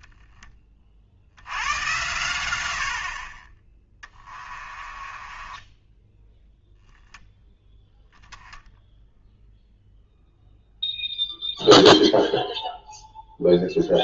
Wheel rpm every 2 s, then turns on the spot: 30, 90, 20, 0, 0, 0, 0.
4-6